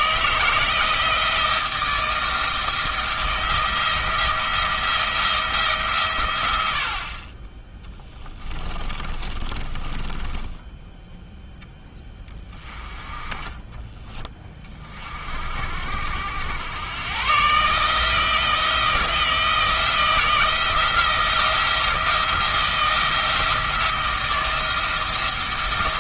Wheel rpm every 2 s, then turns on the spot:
160, 160, 170, 80, 20, 10, 20, 30, 100, 160, 160, 170, 170.
8-10